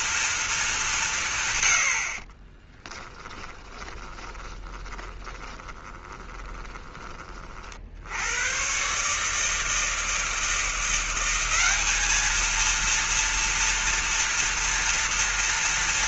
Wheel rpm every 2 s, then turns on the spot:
200, 20, 20, 20, 120, 170, 230, 230.
2-8